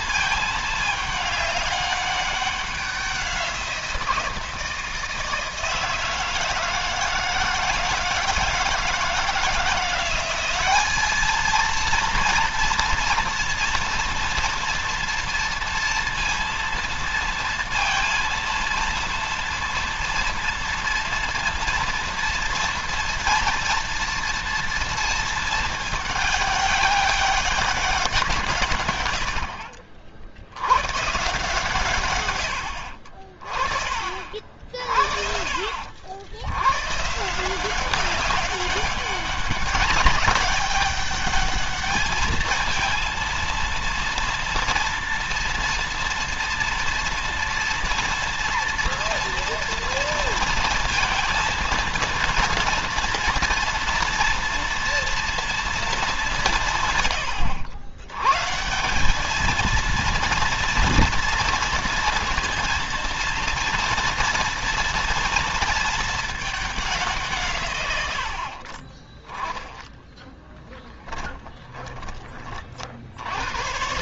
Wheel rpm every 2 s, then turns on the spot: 210, 190, 160, 160, 160, 200, 230, 230, 230, 230, 230, 230, 230, 200, 120, 110, 60, 60, 130, 200, 200, 230, 230, 230, 230, 230, 230, 230, 150, 170, 230, 230, 230, 190, 40, 10, 40.
70-72